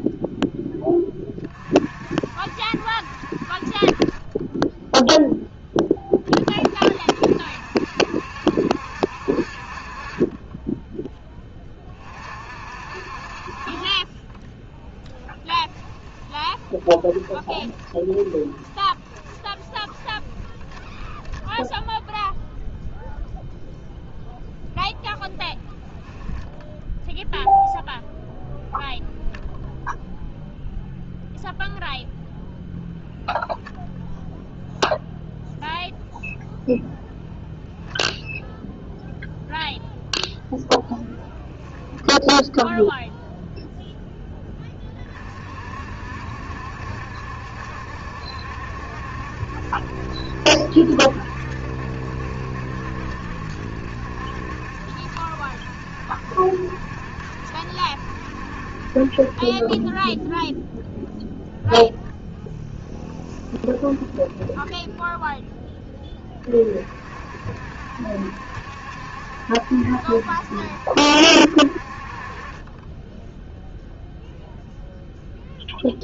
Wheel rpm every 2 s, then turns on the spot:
10, 60, 20, 40, 70, 20, 50, 20, 20, 20, 20, 0, 0, 0, 0, 0, 0, 0, 0, 0, 0, 0, 20, 70, 70, 70, 70, 70, 70, 60, 0, 0, 10, 30, 70, 70, 30, 0.
14-22 64-66